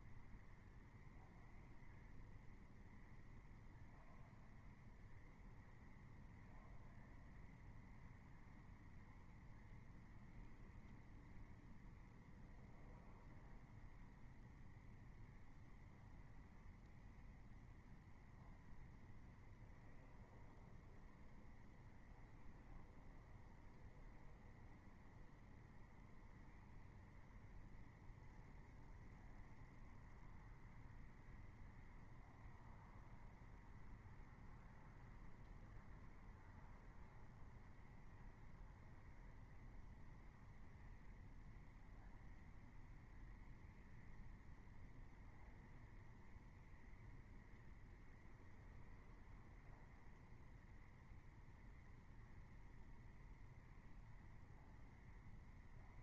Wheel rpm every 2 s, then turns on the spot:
0, 0, 0, 0, 0, 0, 0, 0, 0, 0, 0, 0, 0, 0, 0, 0, 0, 0, 0, 0, 0, 0, 0, 0, 0, 0, 0, 0.
none